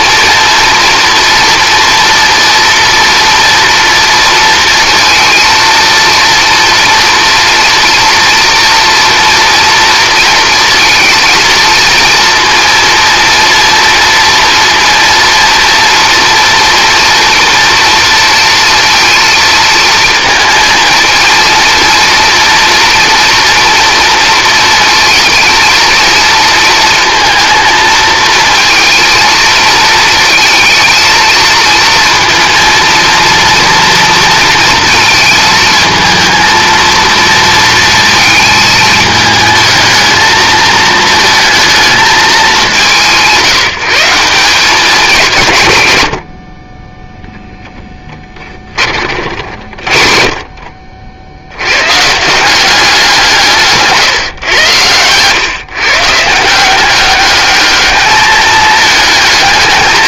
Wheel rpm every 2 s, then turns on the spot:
230, 230, 230, 240, 230, 230, 230, 230, 240, 230, 220, 230, 230, 230, 230, 220, 230, 230, 230, 220, 220, 180, 190, 20, 30, 40, 190, 120, 180, 220.
none